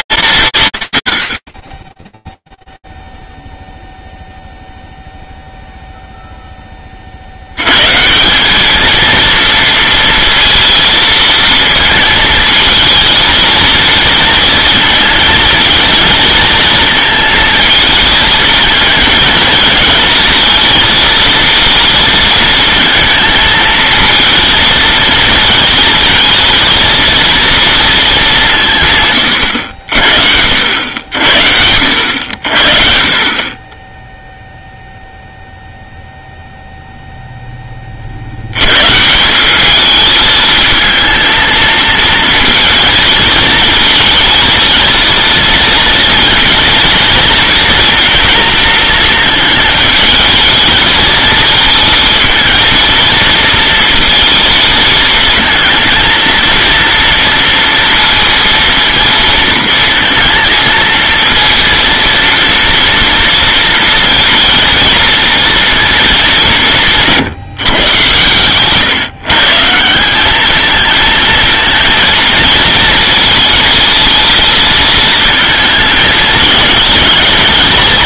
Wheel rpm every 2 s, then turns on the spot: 150, 0, 0, 10, 210, 230, 220, 230, 230, 220, 230, 230, 230, 230, 160, 90, 50, 0, 0, 120, 220, 220, 230, 230, 220, 220, 230, 230, 230, 230, 230, 230, 230, 180, 130, 220, 230, 220, 220.
none